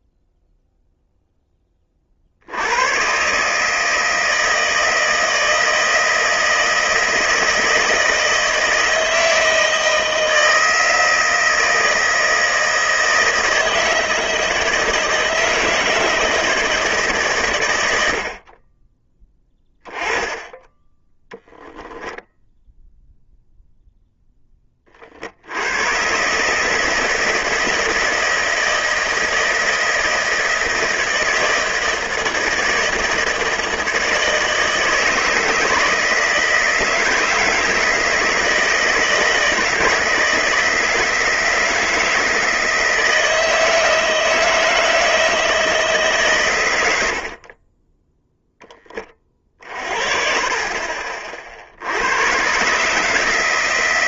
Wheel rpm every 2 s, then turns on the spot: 0, 110, 160, 160, 160, 160, 160, 160, 150, 30, 10, 10, 20, 150, 160, 160, 160, 160, 160, 160, 160, 160, 160, 90, 20, 30, 140.
none